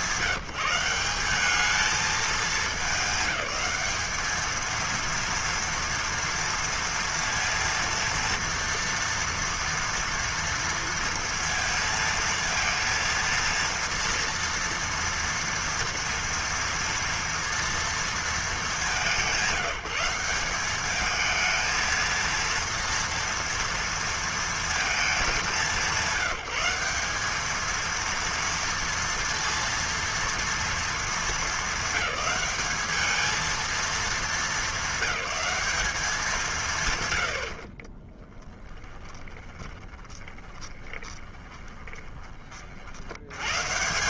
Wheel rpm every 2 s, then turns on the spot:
180, 210, 230, 230, 230, 230, 230, 230, 230, 200, 200, 230, 220, 190, 230, 220, 210, 200, 130, 20, 20, 70.
38-42